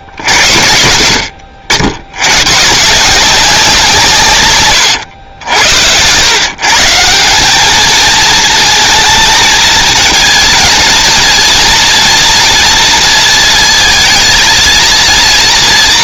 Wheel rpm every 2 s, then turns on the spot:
80, 130, 120, 150, 220, 230, 230, 220.
none